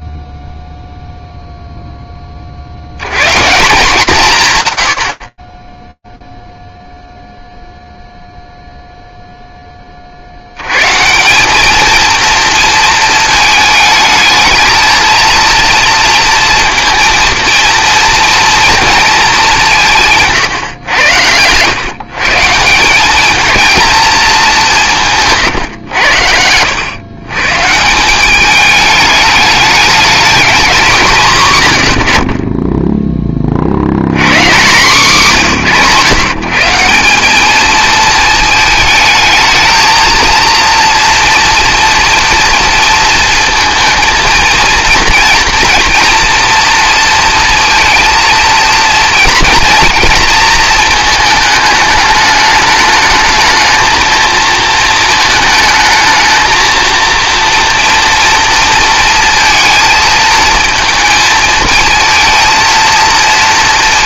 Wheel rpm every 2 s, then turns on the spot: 0, 70, 110, 0, 0, 180, 230, 230, 230, 210, 110, 210, 160, 120, 210, 160, 20, 160, 200, 220, 230, 230, 230, 230, 230, 220, 220, 220, 230, 230, 220, 230.
none